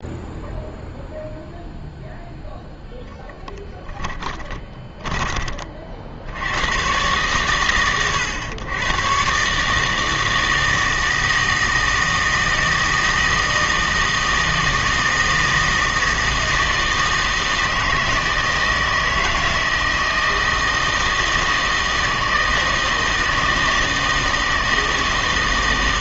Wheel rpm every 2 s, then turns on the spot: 0, 10, 10, 90, 110, 160, 160, 160, 160, 160, 160, 160, 160.
4-6